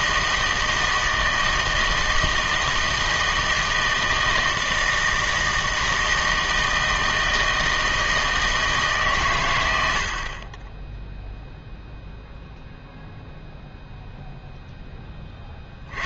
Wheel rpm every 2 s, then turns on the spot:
160, 160, 160, 160, 160, 20, 0, 0.
none